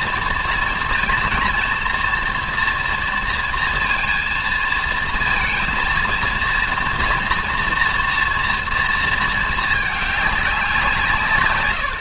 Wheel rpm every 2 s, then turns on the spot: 230, 230, 220, 230, 230, 190.
none